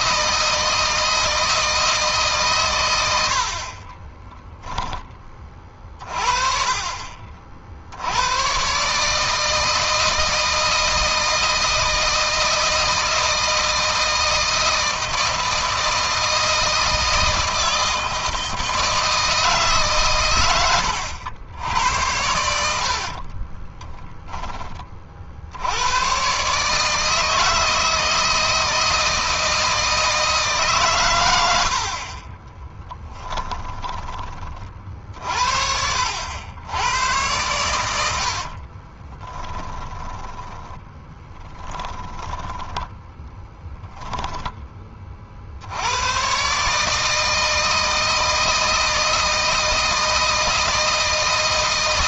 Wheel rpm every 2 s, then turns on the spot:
160, 120, 10, 40, 130, 160, 160, 160, 160, 160, 100, 70, 20, 140, 160, 140, 10, 40, 100, 40, 20, 10, 20, 140, 160, 160.
22-24 32-34 38-44